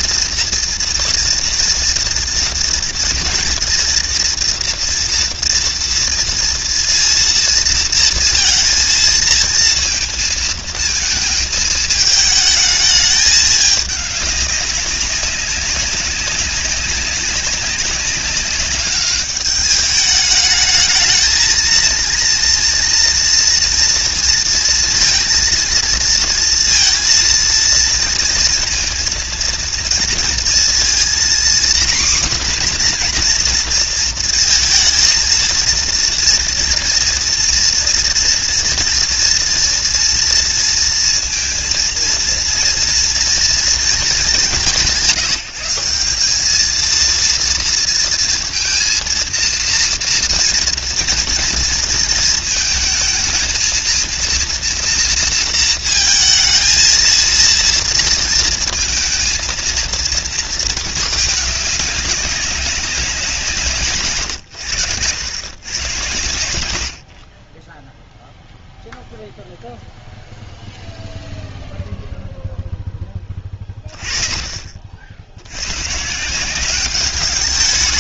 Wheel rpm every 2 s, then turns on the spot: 230, 230, 230, 230, 230, 230, 210, 200, 190, 200, 220, 240, 230, 230, 230, 230, 260, 230, 230, 230, 230, 230, 190, 210, 230, 230, 230, 240, 230, 230, 220, 200, 110, 110, 0, 0, 0, 40, 190.
none